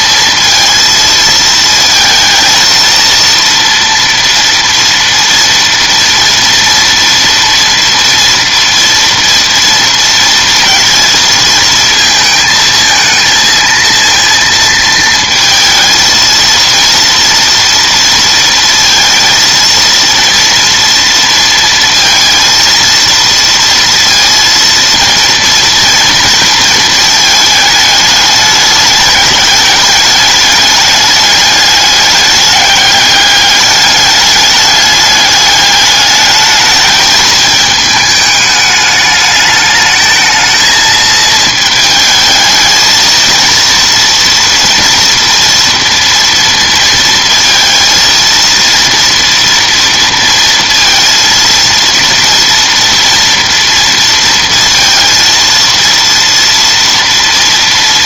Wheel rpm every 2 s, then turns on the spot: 230, 230, 230, 230, 230, 230, 220, 230, 230, 230, 230, 230, 230, 230, 210, 210, 200, 200, 210, 210, 220, 220, 240, 230, 230, 230, 230, 230, 230.
none